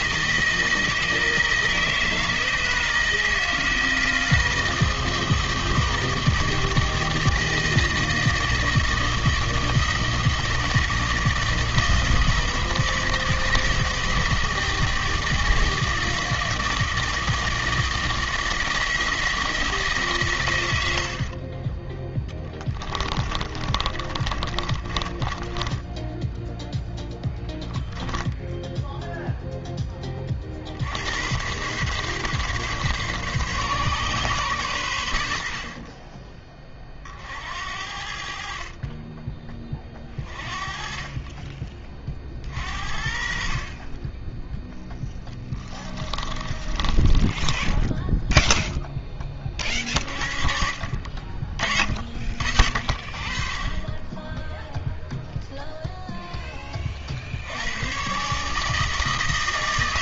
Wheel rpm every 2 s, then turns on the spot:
160, 160, 160, 160, 160, 160, 160, 160, 160, 170, 40, 20, 20, 10, 0, 100, 140, 80, 50, 20, 30, 50, 10, 20, 10, 40, 50, 0, 40, 160.
22-28 46-48